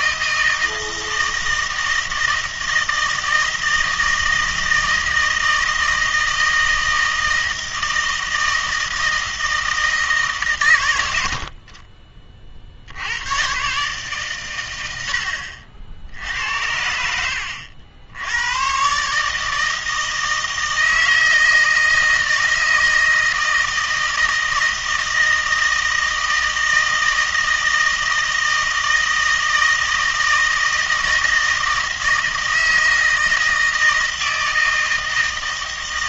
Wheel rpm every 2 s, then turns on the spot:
160, 160, 160, 160, 160, 120, 60, 100, 80, 120, 160, 160, 160, 160, 160, 160, 160, 160.
none